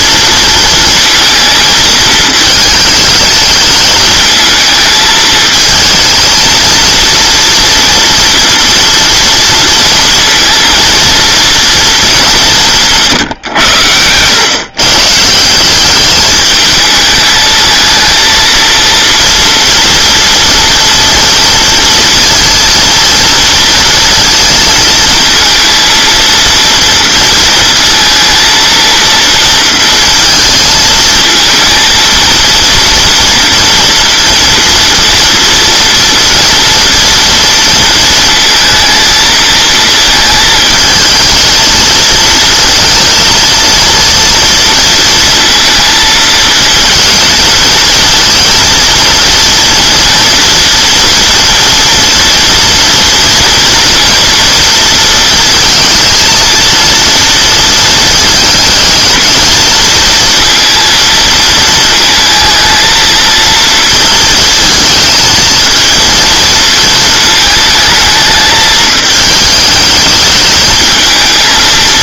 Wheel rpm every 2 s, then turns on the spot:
230, 220, 220, 230, 230, 230, 180, 120, 210, 230, 230, 230, 230, 230, 230, 220, 230, 230, 230, 230, 220, 230, 230, 230, 220, 230, 240, 230, 230, 220, 230, 220, 220, 230, 220, 220.
none